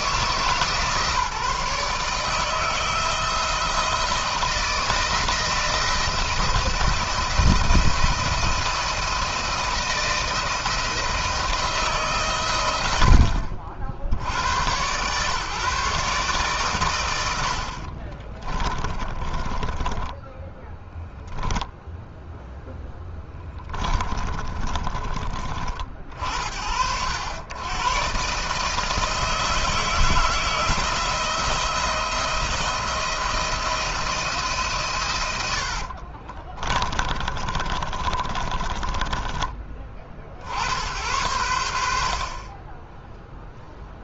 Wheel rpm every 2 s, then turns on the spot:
160, 160, 170, 170, 170, 170, 110, 90, 130, 30, 10, 0, 30, 60, 150, 160, 170, 140, 30, 30, 70, 30.
18-22 24-26 36-40